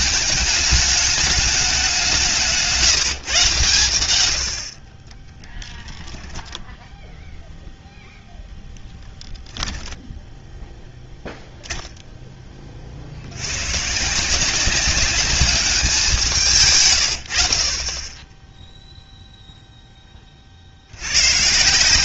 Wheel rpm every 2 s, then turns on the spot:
210, 140, 10, 0, 10, 0, 50, 180, 100, 0, 40.
4-6